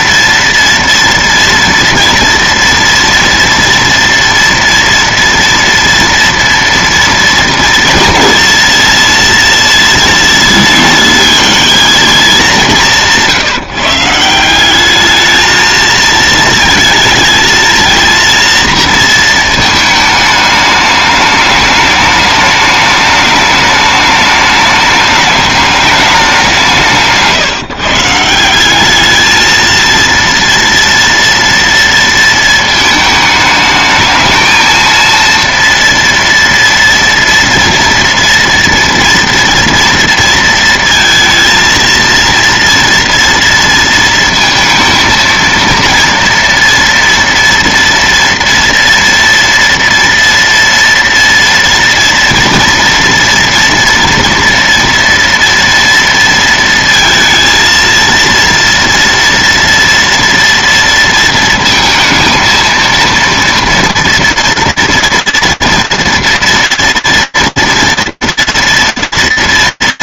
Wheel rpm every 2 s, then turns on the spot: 230, 230, 230, 230, 230, 230, 200, 180, 220, 230, 210, 210, 210, 180, 180, 230, 220, 230, 230, 230, 230, 230, 230, 230, 230, 230, 230, 230, 230, 230, 230, 220, 230, 230, 230.
none